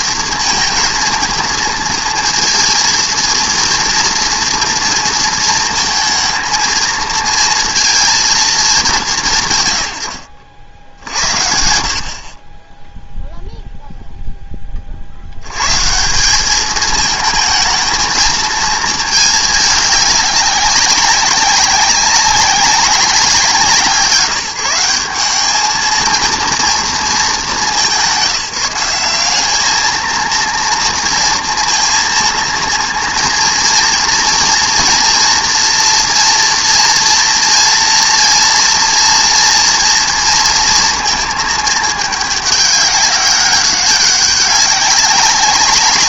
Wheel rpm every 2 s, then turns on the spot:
230, 230, 230, 220, 200, 80, 10, 40, 210, 220, 190, 190, 180, 230, 180, 230, 230, 240, 230, 230, 230, 200, 190.
none